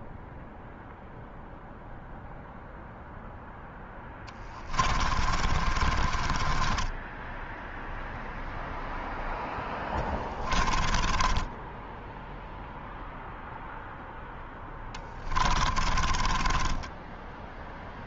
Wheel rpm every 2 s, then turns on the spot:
0, 0, 30, 10, 0, 10, 0, 20, 10.
4-8 10-12 14-18